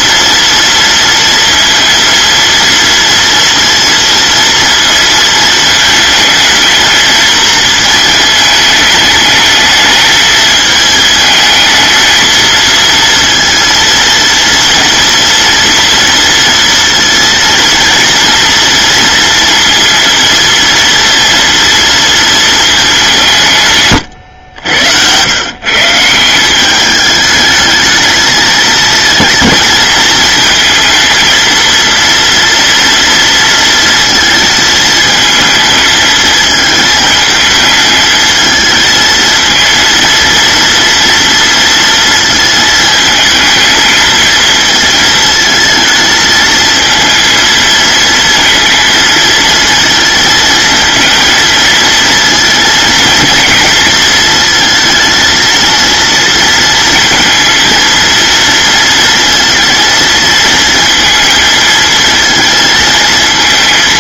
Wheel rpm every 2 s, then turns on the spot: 230, 230, 230, 220, 220, 220, 230, 230, 230, 230, 230, 210, 100, 190, 220, 230, 230, 220, 220, 220, 230, 220, 220, 220, 230, 220, 230, 220, 230, 230, 230, 230.
none